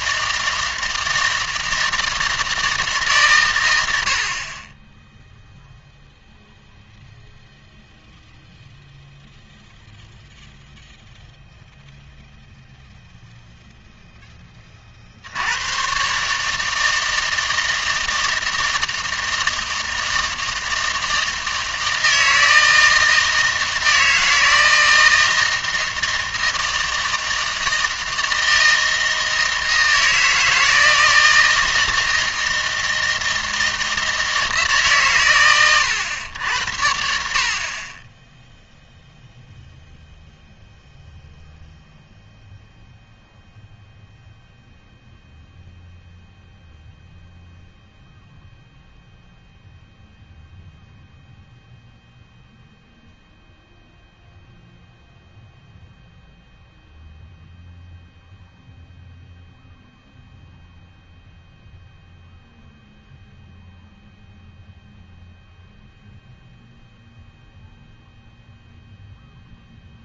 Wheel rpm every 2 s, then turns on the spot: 160, 150, 20, 0, 0, 0, 0, 40, 160, 160, 160, 160, 160, 160, 160, 160, 160, 140, 70, 0, 0, 0, 0, 0, 0, 0, 0, 0, 0, 0, 0, 0, 0, 0, 0.
none